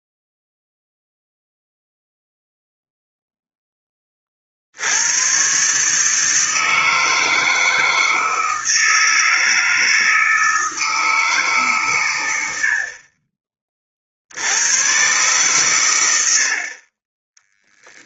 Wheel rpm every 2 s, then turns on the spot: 0, 0, 40, 150, 160, 160, 90, 90, 60.
16-18